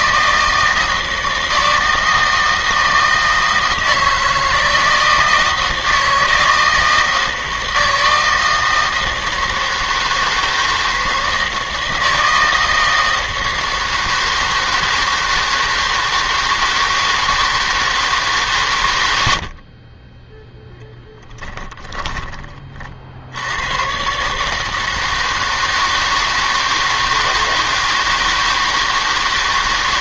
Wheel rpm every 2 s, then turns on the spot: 160, 160, 160, 160, 160, 160, 160, 160, 160, 130, 10, 30, 150, 160, 160.
none